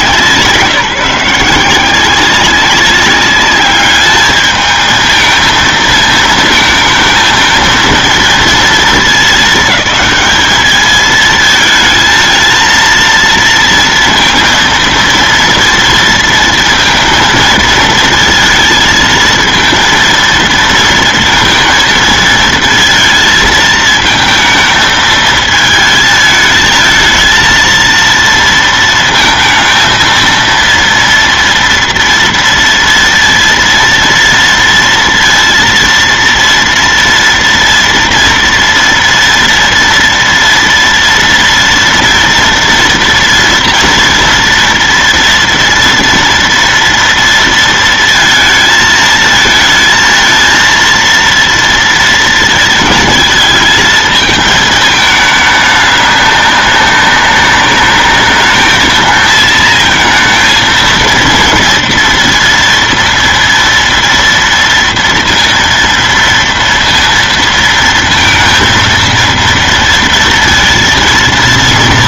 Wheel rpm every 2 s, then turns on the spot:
160, 190, 220, 220, 220, 210, 230, 230, 230, 230, 230, 230, 220, 220, 230, 230, 230, 230, 230, 230, 230, 240, 230, 230, 220, 230, 220, 220, 200, 220, 230, 230, 230, 230, 230, 230.
none